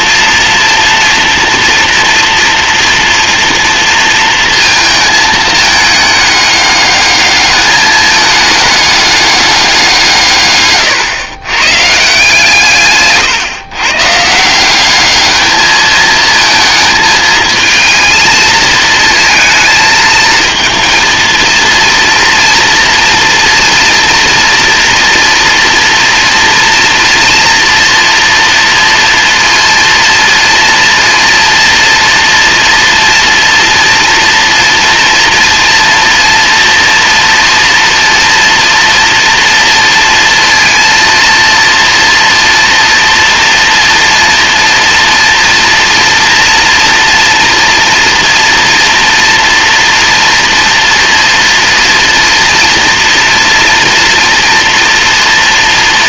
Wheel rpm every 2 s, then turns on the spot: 230, 230, 230, 210, 210, 120, 150, 200, 220, 220, 230, 230, 230, 230, 230, 230, 230, 230, 230, 230, 230, 240, 230, 230, 230, 230, 230, 230.
10-12